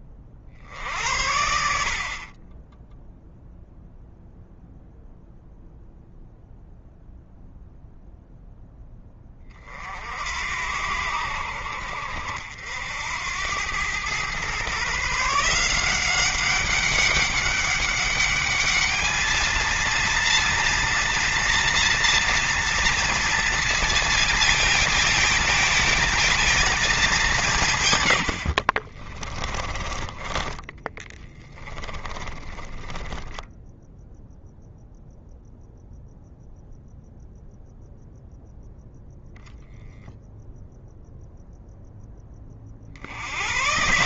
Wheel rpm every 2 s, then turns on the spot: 60, 20, 0, 0, 10, 70, 70, 130, 200, 210, 230, 230, 220, 220, 60, 20, 20, 0, 0, 0, 0, 30.
28-34